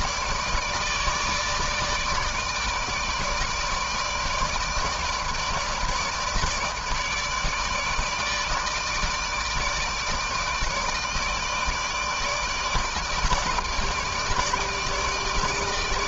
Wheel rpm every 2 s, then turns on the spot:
150, 150, 160, 160, 160, 150, 150, 150.
none